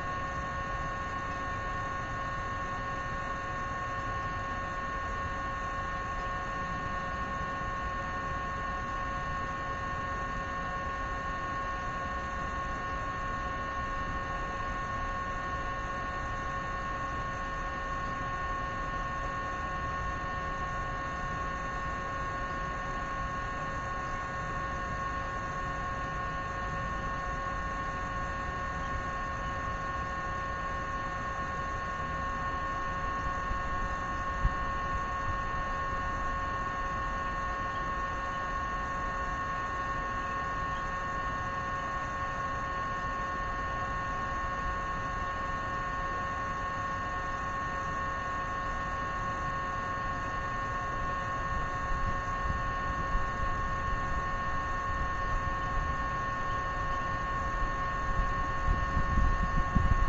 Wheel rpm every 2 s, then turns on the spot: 0, 0, 0, 0, 0, 0, 0, 0, 0, 0, 0, 0, 0, 0, 0, 0, 0, 0, 0, 0, 0, 0, 0, 0, 0, 0, 0, 0, 0, 0.
none